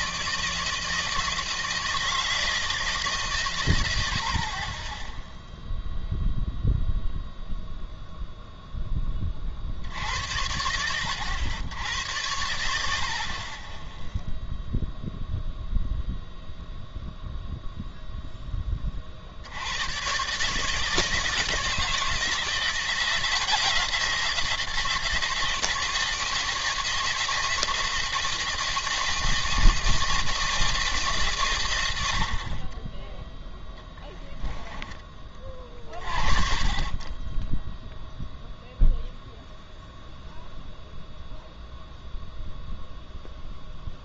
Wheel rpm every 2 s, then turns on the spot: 160, 160, 30, 0, 0, 80, 70, 0, 0, 10, 150, 170, 160, 160, 160, 160, 30, 10, 40, 0, 0, 0.
34-36